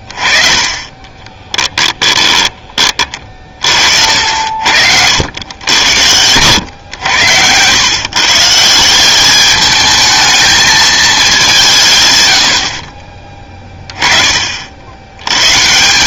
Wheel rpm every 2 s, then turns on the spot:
30, 20, 70, 100, 160, 220, 60, 60.
none